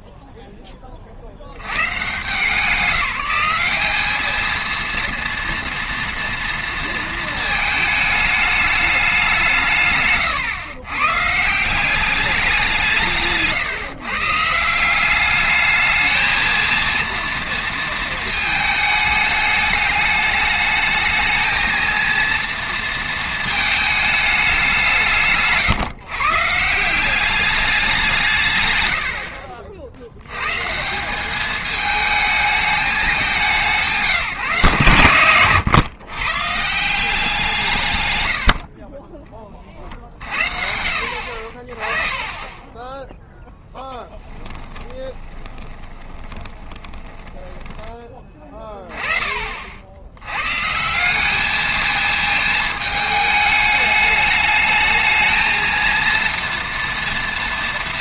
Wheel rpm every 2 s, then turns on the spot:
70, 200, 230, 220, 150, 180, 140, 220, 230, 210, 220, 220, 150, 190, 50, 210, 190, 120, 160, 20, 60, 10, 20, 10, 20, 180, 220, 220, 230.
42-48